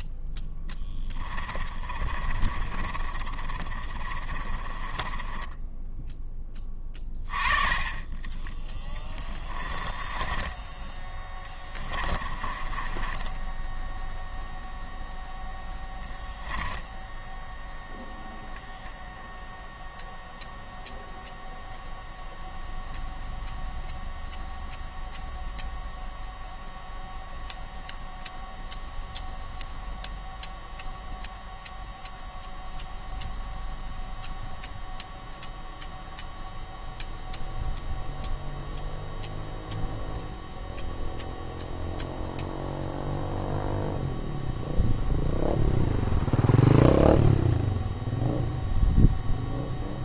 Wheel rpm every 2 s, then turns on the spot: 20, 20, 20, 20, 10, 10, 20, 0, 10, 0, 0, 0, 0, 0, 0, 0, 0, 0, 0, 0, 0, 0, 0, 0, 0.
0-6 8-14 16-18